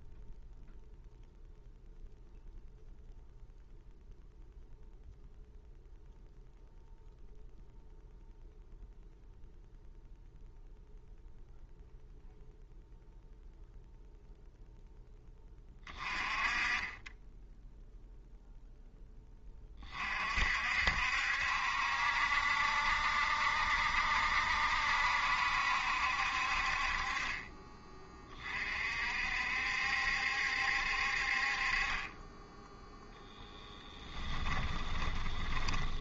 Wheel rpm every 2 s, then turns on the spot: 0, 0, 0, 0, 0, 0, 0, 0, 20, 0, 60, 70, 70, 40, 40, 60, 10, 20.
34-36